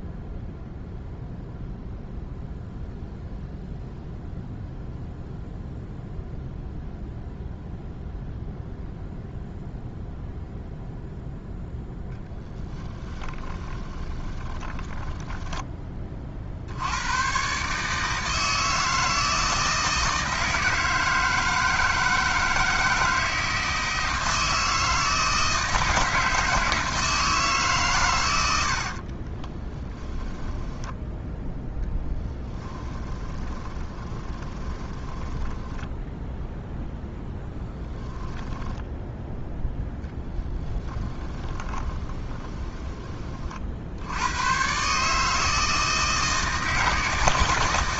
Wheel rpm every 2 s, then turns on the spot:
0, 0, 0, 0, 0, 0, 20, 10, 80, 160, 160, 160, 160, 160, 70, 10, 10, 20, 0, 10, 10, 20, 130, 160.
12-16 28-36 40-44